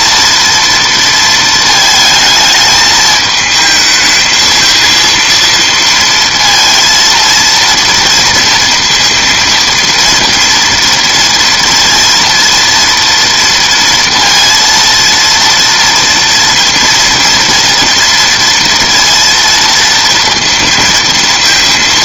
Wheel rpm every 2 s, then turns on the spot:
230, 220, 220, 230, 230, 230, 230, 230, 230, 230, 230.
none